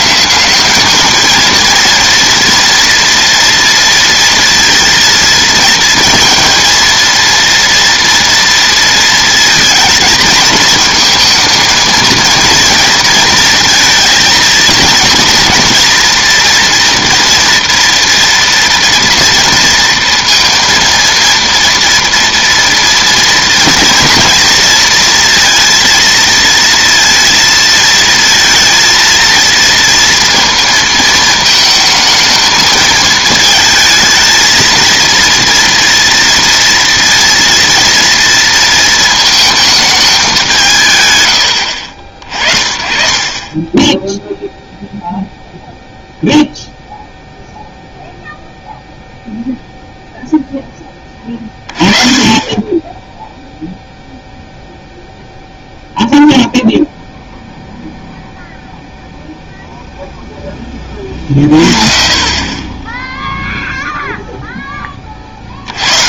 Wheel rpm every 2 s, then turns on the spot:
190, 230, 230, 230, 230, 220, 230, 220, 230, 240, 230, 230, 230, 230, 230, 230, 220, 220, 230, 230, 190, 40, 0, 0, 0, 10, 20, 0, 0, 0, 20, 20, 10.
none